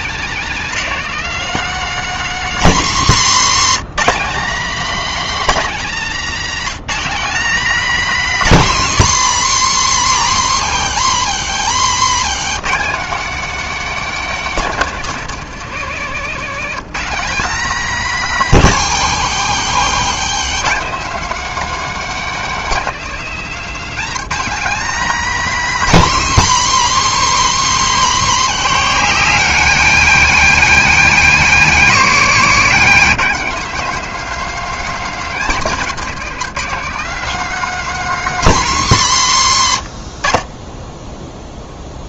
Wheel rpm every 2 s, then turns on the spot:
260, 200, 280, 250, 210, 140, 210, 230, 220, 180, 220, 250, 250, 200, 190, 220, 230, 240, 230, 170, 10.
none